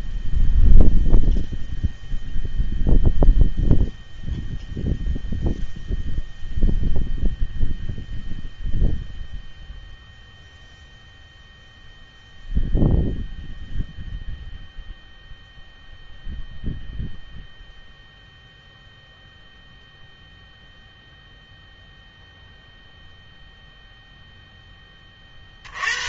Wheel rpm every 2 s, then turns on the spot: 0, 0, 0, 0, 0, 0, 0, 0, 0, 0, 0, 0, 10.
none